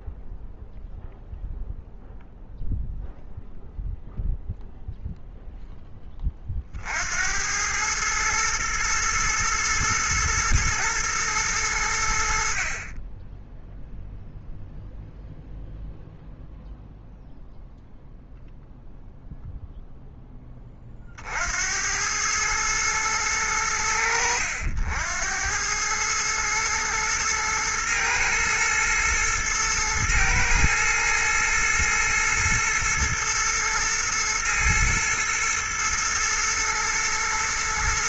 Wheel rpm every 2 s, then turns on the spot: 0, 0, 0, 40, 110, 120, 50, 0, 0, 0, 20, 110, 80, 110, 110, 110, 120, 120, 110.
none